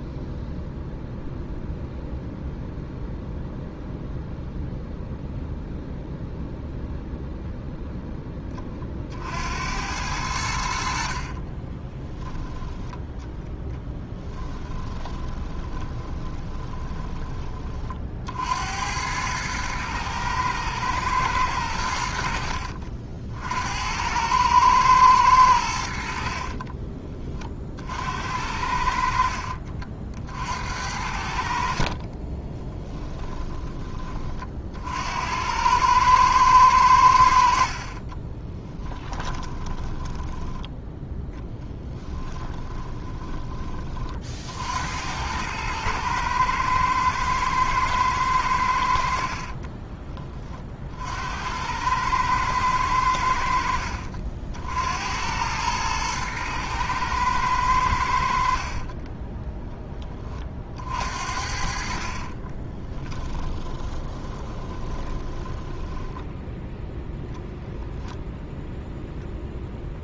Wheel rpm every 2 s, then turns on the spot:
0, 0, 0, 0, 30, 60, 10, 10, 20, 80, 110, 60, 110, 30, 70, 70, 20, 50, 100, 10, 10, 10, 70, 110, 90, 40, 100, 70, 110, 50, 40, 20, 20, 0, 0.
14-18 26-28 32-34 38-40 42-44 62-66